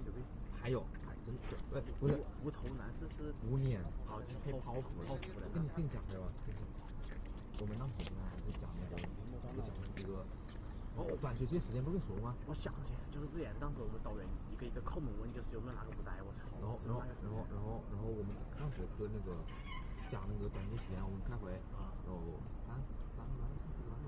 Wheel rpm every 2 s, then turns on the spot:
0, 0, 0, 0, 0, 0, 0, 0, 0, 0, 0, 0.
none